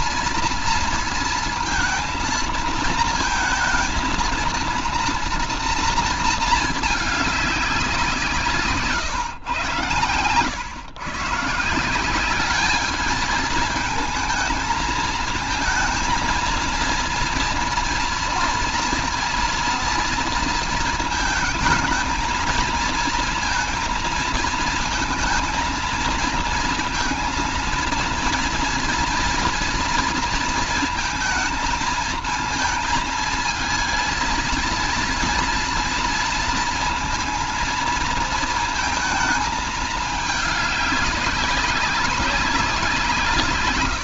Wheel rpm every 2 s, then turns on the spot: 230, 230, 240, 210, 130, 140, 220, 230, 230, 230, 230, 230, 220, 230, 230, 230, 230, 230, 230, 220, 200, 160.
none